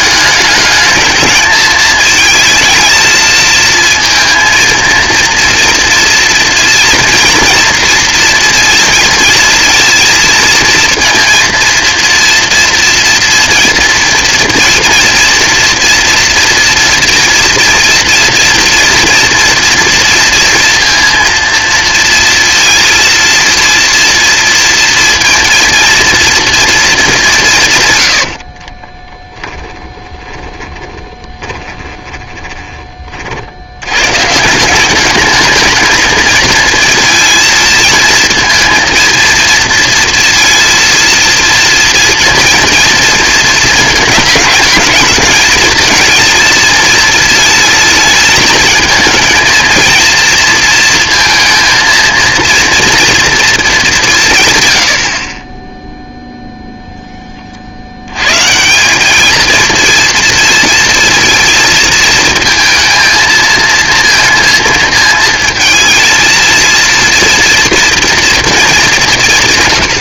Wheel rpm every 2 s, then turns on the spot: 210, 220, 230, 230, 230, 230, 230, 230, 230, 230, 230, 230, 230, 230, 60, 20, 30, 170, 230, 220, 230, 230, 210, 230, 220, 230, 230, 120, 0, 160, 230, 230, 220, 230, 220.
28-32